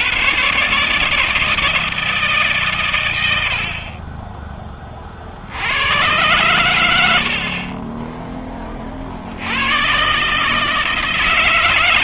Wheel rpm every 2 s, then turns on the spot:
100, 150, 20, 100, 20, 150.
none